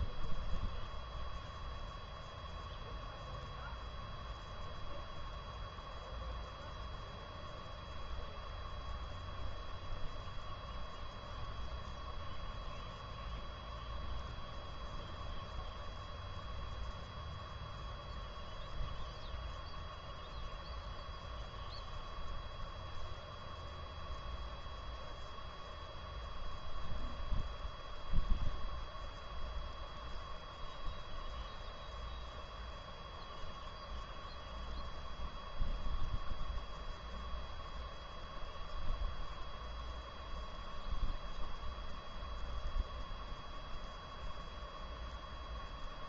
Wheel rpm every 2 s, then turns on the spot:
0, 0, 0, 0, 0, 0, 0, 0, 0, 0, 0, 0, 0, 0, 0, 0, 0, 0, 0, 0, 0, 0, 0.
none